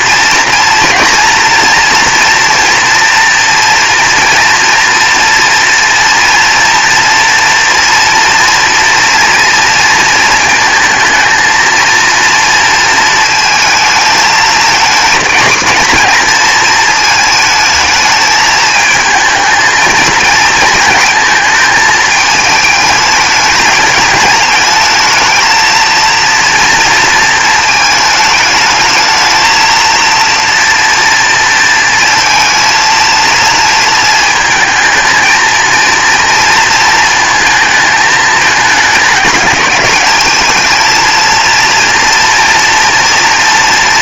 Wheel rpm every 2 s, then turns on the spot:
230, 240, 230, 230, 230, 220, 230, 220, 220, 220, 220, 210, 220, 230, 220, 230, 230, 220, 230, 210, 230, 240.
none